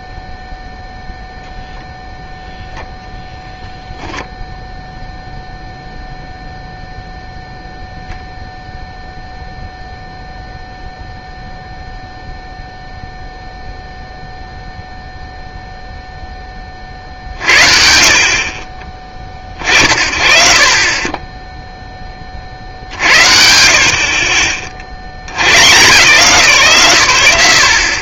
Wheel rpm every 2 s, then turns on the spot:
0, 0, 0, 0, 0, 0, 0, 0, 30, 40, 30, 70, 60, 130.
none